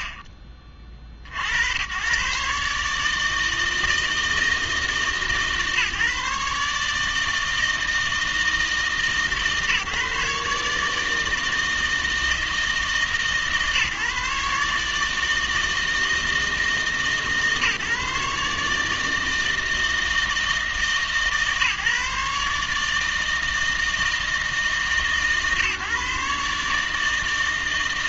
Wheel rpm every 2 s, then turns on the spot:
40, 140, 160, 150, 160, 150, 160, 150, 160, 150, 150, 150, 160, 150.
0-2